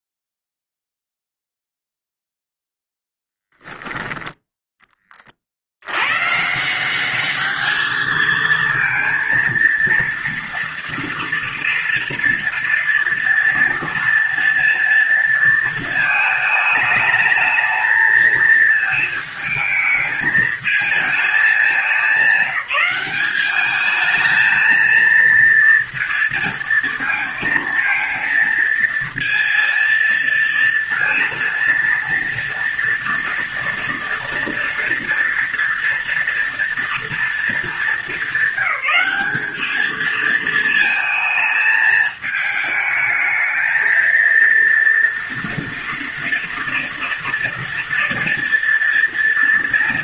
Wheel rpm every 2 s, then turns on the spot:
0, 0, 20, 180, 230, 230, 230, 230, 210, 220, 220, 190, 230, 230, 230, 230, 230, 230, 230, 200, 220, 220, 230, 230, 230.
none